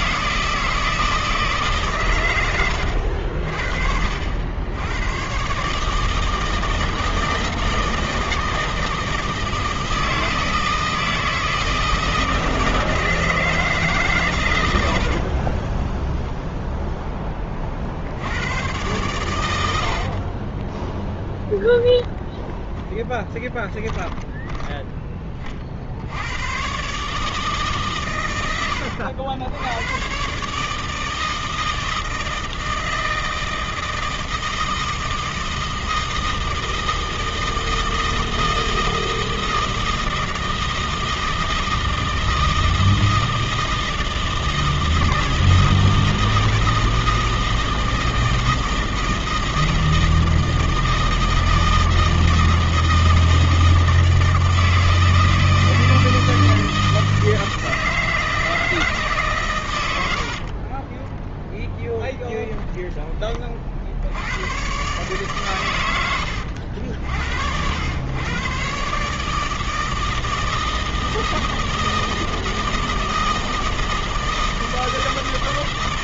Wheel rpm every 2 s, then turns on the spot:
160, 70, 110, 160, 160, 160, 160, 70, 10, 110, 10, 10, 20, 150, 90, 160, 160, 160, 160, 160, 160, 160, 160, 160, 160, 160, 160, 160, 160, 150, 20, 20, 130, 70, 150, 160, 160, 160.
14-16 20-24 60-62